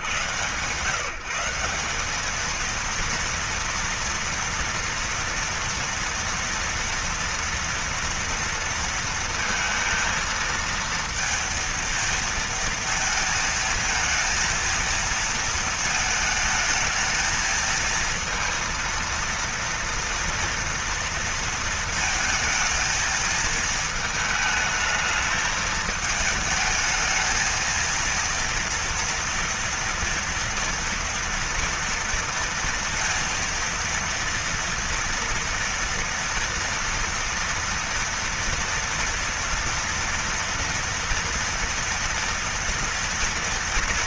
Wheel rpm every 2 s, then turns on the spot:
100, 200, 230, 230, 230, 230, 230, 230, 220, 230, 230, 230, 220, 220, 230, 230, 230, 230, 230, 230, 230, 230.
none